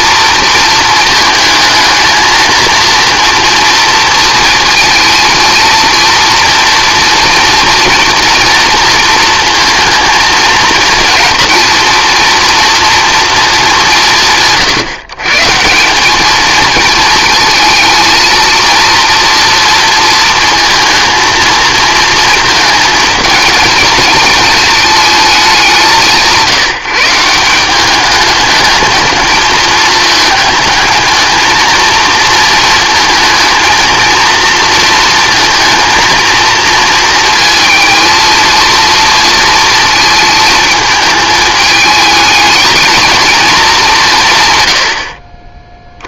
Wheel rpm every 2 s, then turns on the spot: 220, 230, 230, 230, 230, 230, 230, 140, 220, 230, 220, 220, 220, 160, 210, 220, 220, 230, 230, 230, 220, 220, 80.
none